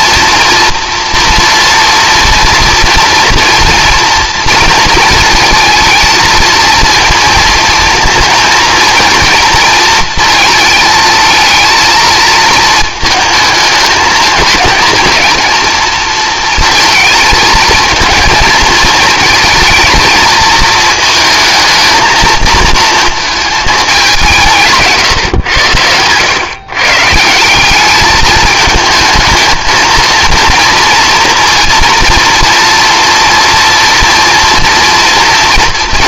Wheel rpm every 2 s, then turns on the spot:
230, 230, 230, 230, 230, 220, 230, 230, 230, 230, 220, 230, 150, 130, 220, 230, 230, 230.
none